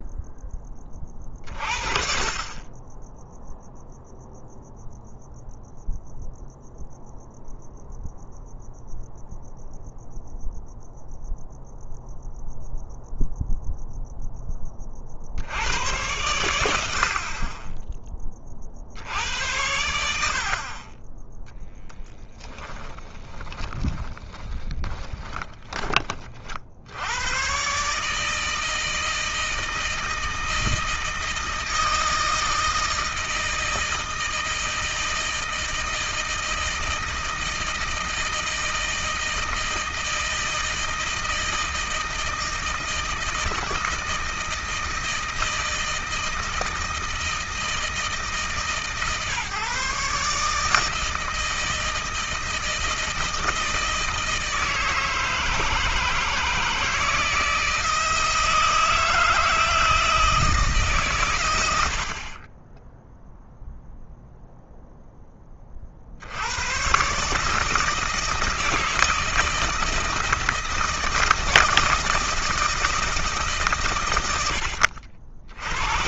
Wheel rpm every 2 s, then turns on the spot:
30, 10, 0, 0, 0, 0, 0, 50, 60, 60, 20, 10, 20, 90, 160, 160, 160, 160, 160, 160, 160, 160, 160, 160, 140, 160, 160, 160, 160, 160, 150, 10, 0, 120, 160, 160, 160, 80.
22-26